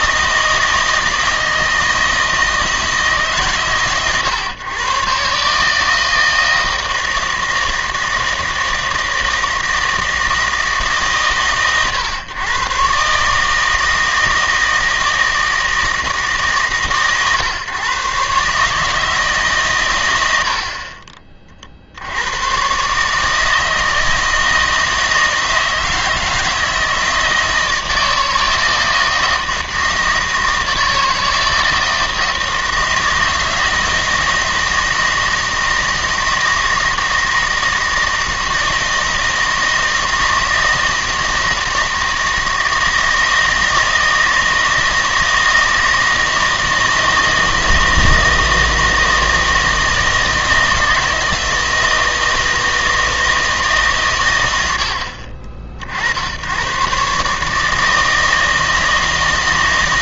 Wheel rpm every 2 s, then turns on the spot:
160, 160, 120, 160, 160, 150, 130, 160, 140, 150, 40, 130, 160, 160, 160, 160, 160, 160, 160, 160, 160, 160, 160, 160, 160, 160, 160, 90, 120, 160.
none